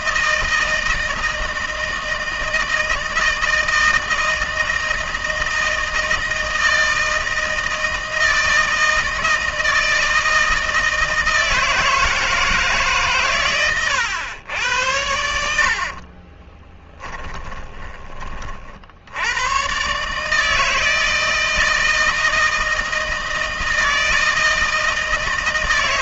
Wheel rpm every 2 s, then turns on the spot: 160, 160, 160, 160, 160, 160, 140, 70, 20, 70, 160, 160, 160.
16-18